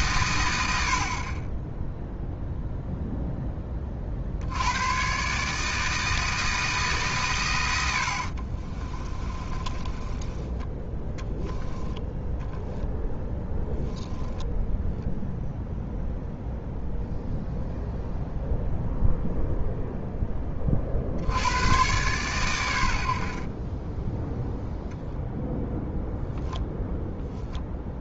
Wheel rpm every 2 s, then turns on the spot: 110, 0, 60, 160, 60, 10, 20, 0, 0, 0, 20, 110, 10, 0.
8-14